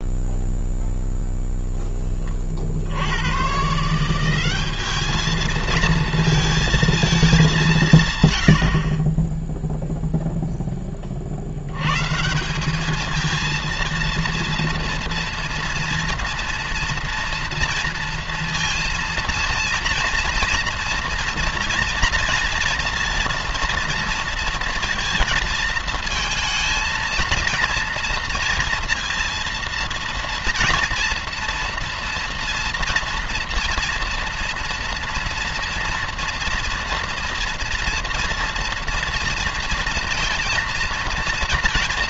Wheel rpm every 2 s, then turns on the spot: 10, 90, 210, 220, 50, 20, 210, 230, 230, 230, 240, 230, 230, 220, 230, 230, 240, 230, 230, 230, 230.
none